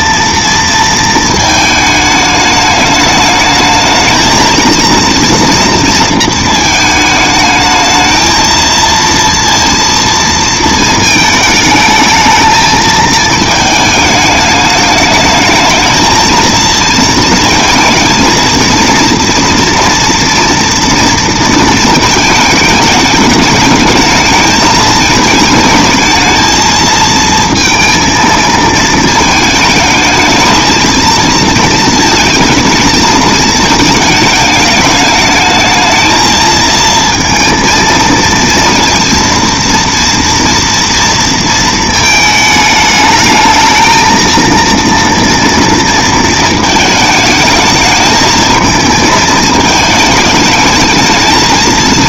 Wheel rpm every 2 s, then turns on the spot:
230, 210, 230, 220, 230, 220, 220, 210, 230, 230, 230, 210, 220, 220, 220, 220, 220, 210, 220, 230, 230, 220, 230, 220, 220, 220.
none